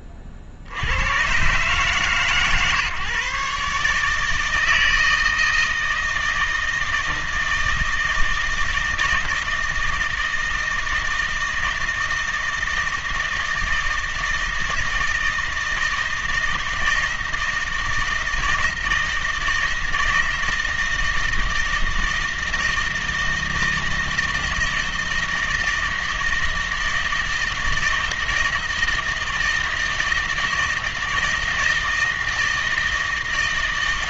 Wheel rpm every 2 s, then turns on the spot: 30, 150, 160, 160, 160, 160, 160, 160, 160, 160, 160, 160, 160, 160, 160, 160, 160.
none